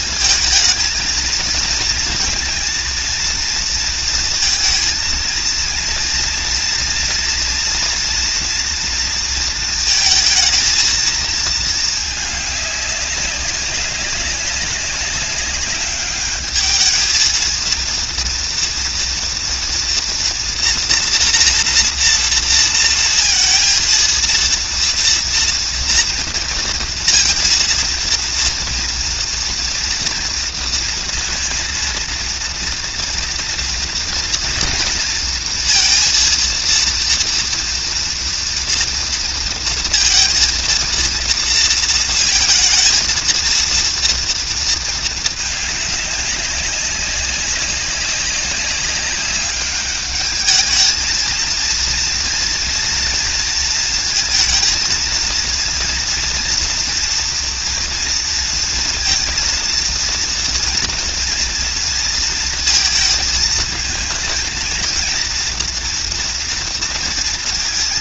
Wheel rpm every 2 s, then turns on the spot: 220, 230, 230, 240, 240, 230, 210, 200, 210, 230, 240, 230, 230, 230, 230, 230, 230, 230, 230, 230, 230, 230, 230, 190, 190, 210, 230, 230, 230, 230, 230, 230, 230, 230.
none